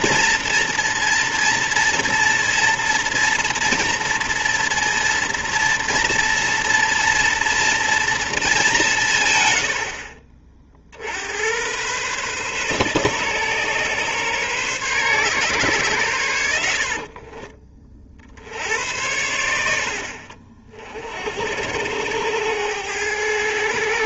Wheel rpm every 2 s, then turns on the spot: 230, 230, 230, 230, 180, 50, 130, 130, 70, 80, 50, 100.
none